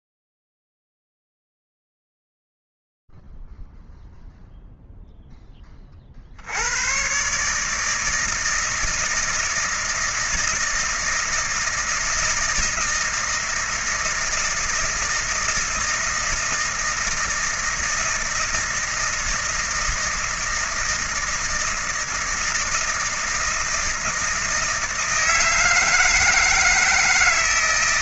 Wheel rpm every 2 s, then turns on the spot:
0, 0, 0, 60, 160, 160, 160, 160, 160, 160, 160, 160, 160, 160.
none